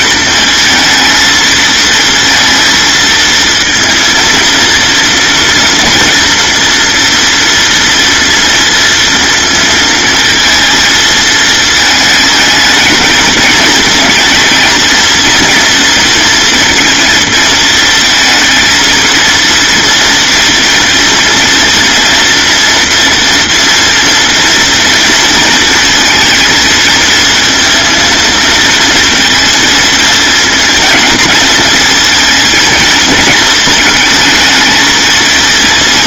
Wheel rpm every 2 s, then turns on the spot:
220, 230, 230, 230, 230, 230, 220, 230, 230, 230, 240, 230, 230, 230, 230, 230, 220, 220.
none